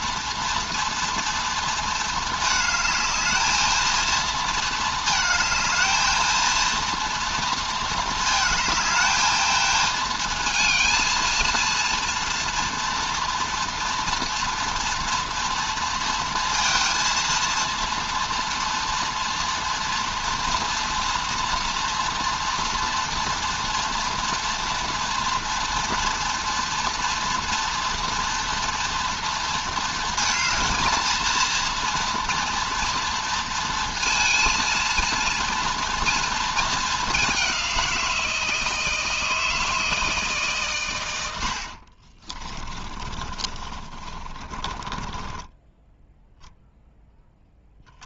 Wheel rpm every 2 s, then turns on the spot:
230, 220, 220, 230, 220, 230, 230, 230, 230, 230, 230, 230, 240, 240, 230, 220, 230, 220, 220, 160, 130, 30, 20, 0.
42-46